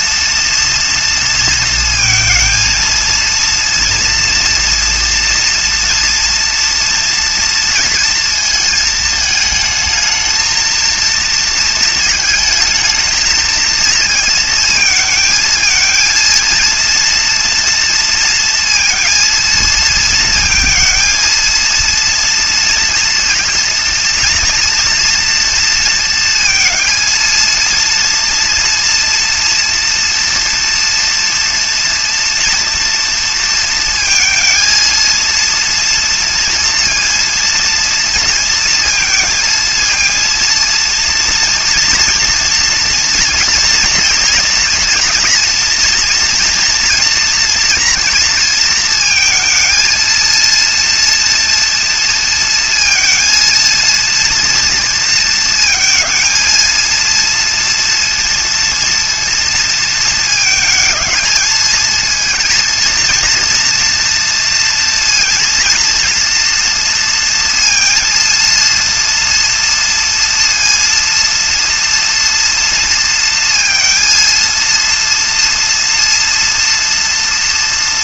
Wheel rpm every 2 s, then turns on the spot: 230, 230, 230, 230, 220, 230, 220, 220, 230, 230, 230, 230, 230, 230, 240, 230, 230, 230, 230, 230, 230, 230, 240, 230, 230, 230, 230, 230, 230, 230, 220, 230, 230, 230, 230, 230, 230, 230, 240.
none